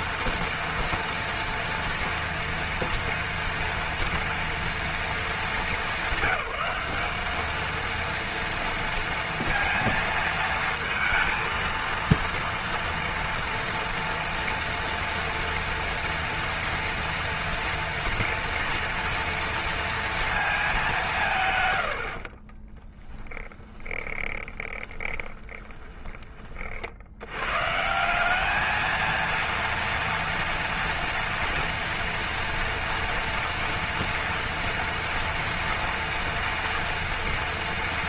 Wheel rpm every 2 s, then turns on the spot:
230, 240, 230, 200, 230, 230, 230, 230, 230, 230, 230, 60, 20, 30, 200, 230, 230, 230, 230.
22-26